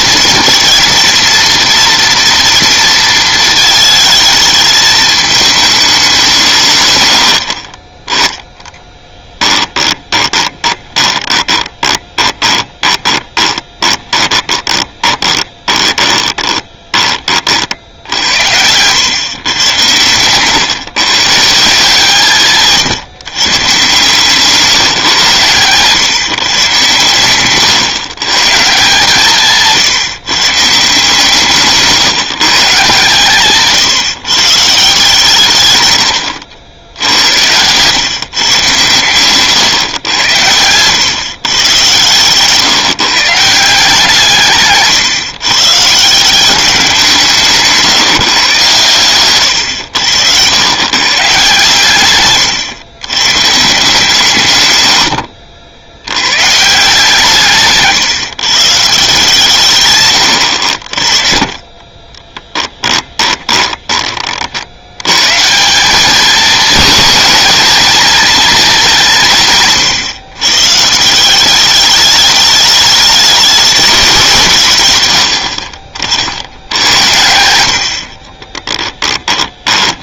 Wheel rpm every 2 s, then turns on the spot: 230, 230, 220, 130, 10, 20, 20, 20, 20, 100, 130, 150, 160, 120, 150, 150, 150, 160, 90, 120, 110, 140, 140, 180, 120, 110, 120, 120, 150, 150, 60, 10, 70, 220, 220, 140, 210, 130, 90, 20.
10-18 24-26 36-38 44-46 62-64 78-80